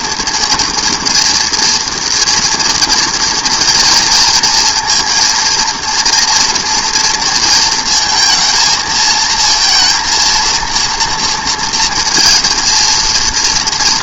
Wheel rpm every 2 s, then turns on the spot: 230, 230, 230, 230, 220, 230, 230.
none